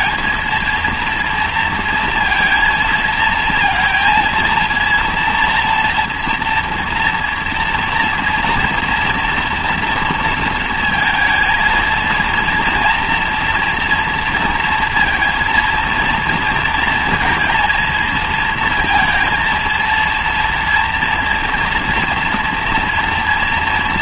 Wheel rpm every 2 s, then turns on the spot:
230, 230, 230, 230, 240, 230, 240, 230, 230, 230, 230, 230.
none